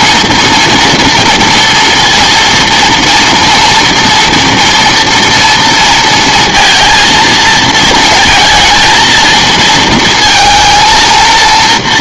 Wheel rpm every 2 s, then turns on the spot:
230, 230, 230, 230, 220, 220.
none